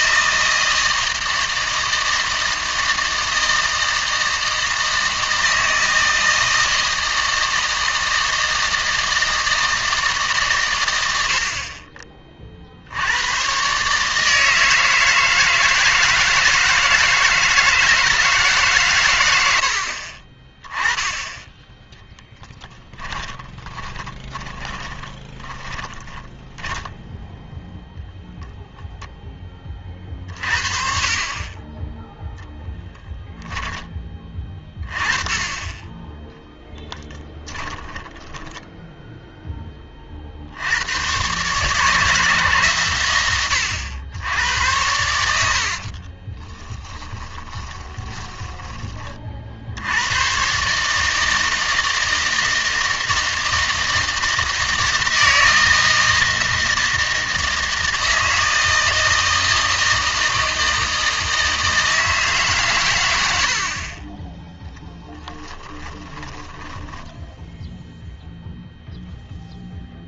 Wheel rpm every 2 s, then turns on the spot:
160, 160, 160, 160, 160, 110, 60, 160, 160, 140, 20, 20, 20, 10, 0, 60, 0, 20, 0, 10, 80, 140, 90, 20, 20, 140, 160, 160, 160, 160, 160, 130, 10, 10, 0.
22-28 38-40 46-48 64-68